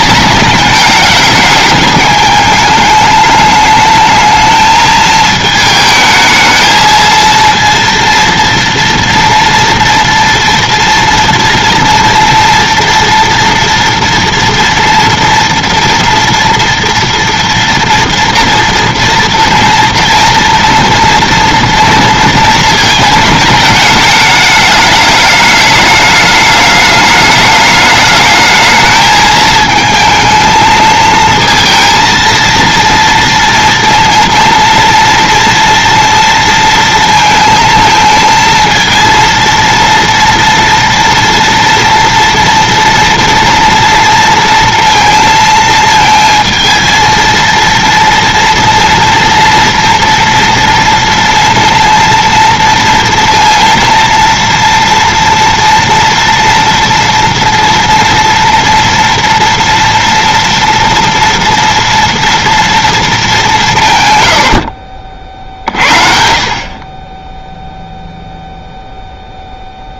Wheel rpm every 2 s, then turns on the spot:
210, 210, 220, 220, 230, 230, 230, 230, 230, 230, 230, 220, 210, 210, 220, 220, 230, 230, 230, 230, 230, 230, 230, 220, 230, 230, 230, 240, 230, 240, 230, 230, 60, 40, 0.
64-66